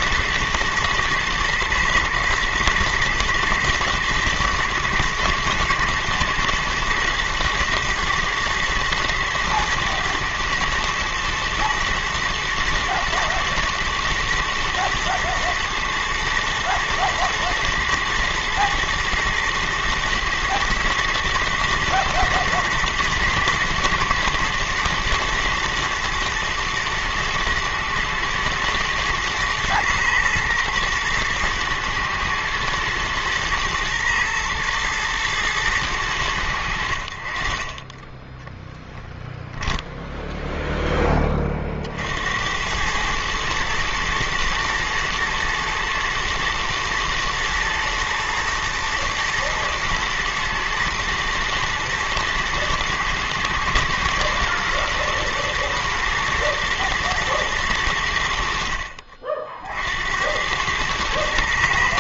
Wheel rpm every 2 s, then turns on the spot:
120, 110, 110, 110, 120, 110, 120, 120, 110, 110, 110, 120, 120, 110, 110, 120, 110, 120, 90, 10, 0, 90, 110, 120, 110, 110, 110, 120, 120, 60, 100.
none